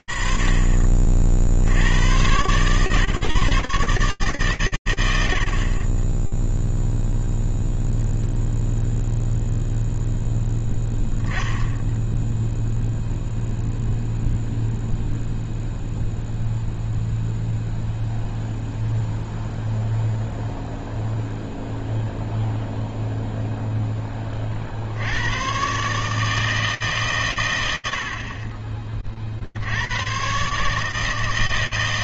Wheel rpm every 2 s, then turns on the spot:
30, 100, 150, 20, 0, 10, 0, 0, 0, 0, 0, 0, 40, 150, 40, 140.
none